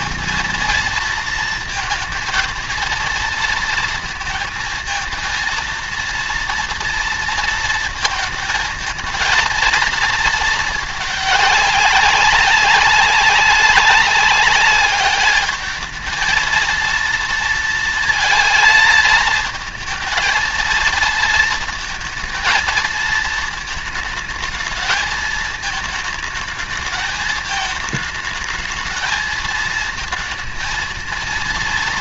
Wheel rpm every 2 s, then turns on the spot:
230, 230, 230, 230, 230, 220, 190, 200, 230, 230, 230, 220, 220, 220, 220, 230.
none